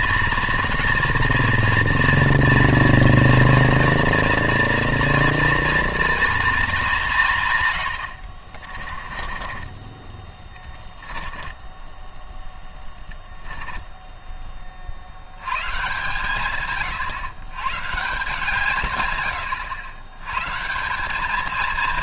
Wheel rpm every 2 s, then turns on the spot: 240, 230, 230, 200, 30, 20, 10, 60, 140, 130, 190.
8-12